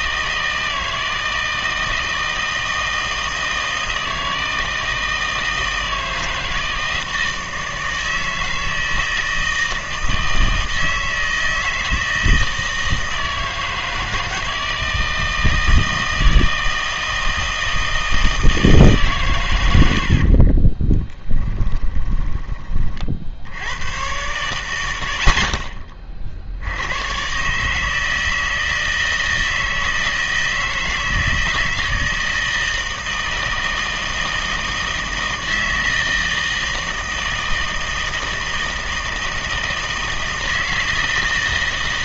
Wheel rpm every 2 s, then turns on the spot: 160, 160, 160, 160, 160, 160, 160, 160, 160, 160, 20, 20, 80, 90, 160, 160, 160, 160, 160, 160, 160.
20-22